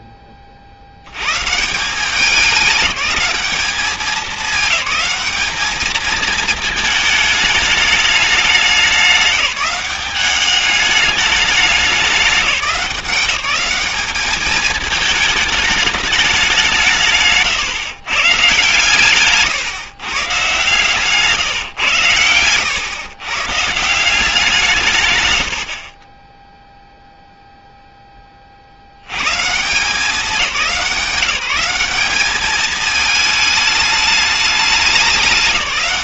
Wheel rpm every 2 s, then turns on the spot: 60, 200, 210, 220, 200, 200, 200, 210, 180, 150, 150, 110, 180, 0, 60, 180, 210, 210.
none